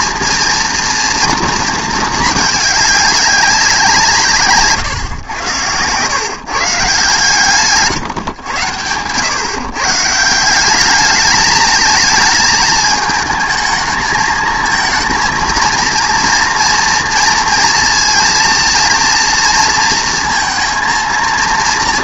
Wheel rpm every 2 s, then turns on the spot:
230, 210, 140, 150, 130, 200, 220, 220, 230, 230, 230.
4-6